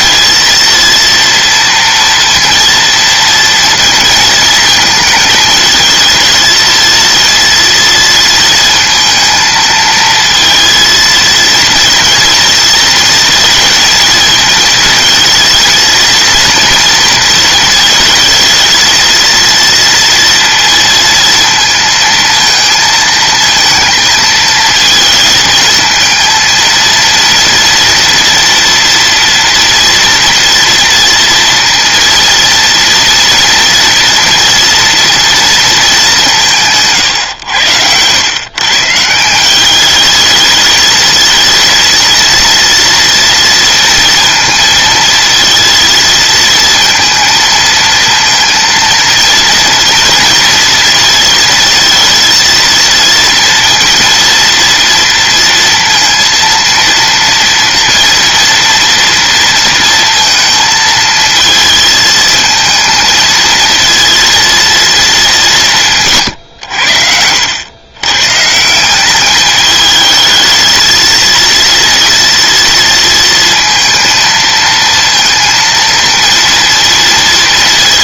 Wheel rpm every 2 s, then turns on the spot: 230, 230, 220, 230, 230, 230, 230, 230, 230, 220, 230, 230, 220, 230, 230, 230, 230, 230, 150, 140, 220, 230, 230, 230, 230, 230, 230, 230, 230, 230, 220, 220, 230, 90, 180, 230, 230, 230, 230.
36-38